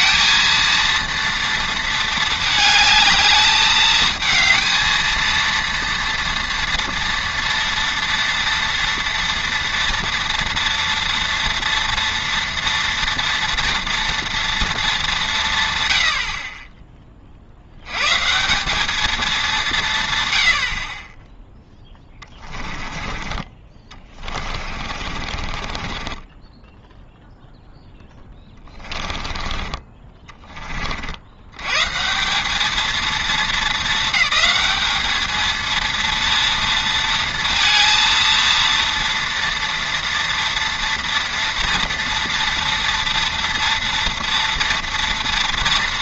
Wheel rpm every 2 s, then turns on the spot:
230, 220, 230, 230, 230, 230, 240, 230, 30, 180, 60, 20, 30, 10, 20, 40, 210, 200, 230, 230, 230, 230, 230.
22-30